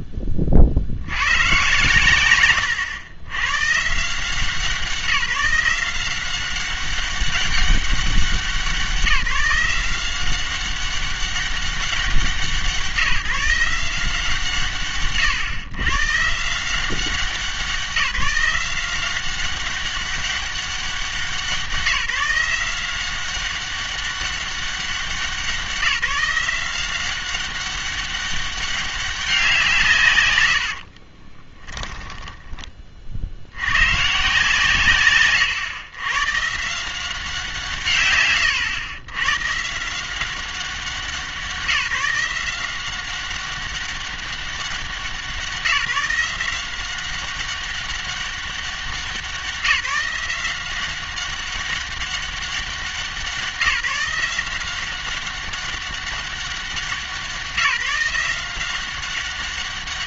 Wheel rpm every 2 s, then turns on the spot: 40, 120, 170, 190, 180, 190, 170, 140, 180, 180, 190, 180, 190, 180, 200, 90, 20, 150, 160, 110, 190, 180, 190, 190, 190, 180, 190, 190, 190, 180.
30-32